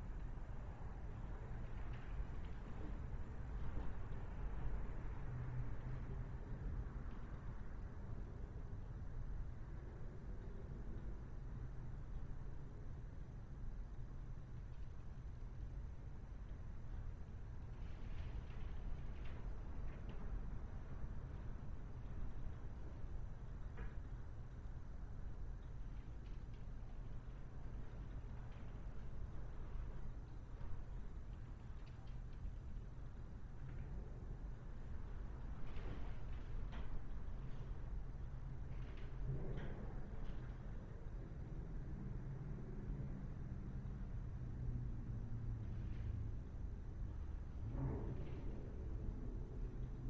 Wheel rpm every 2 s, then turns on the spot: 0, 0, 0, 0, 0, 0, 0, 0, 0, 0, 0, 0, 0, 0, 0, 0, 0, 0, 0, 0, 0, 0, 0, 0, 0.
none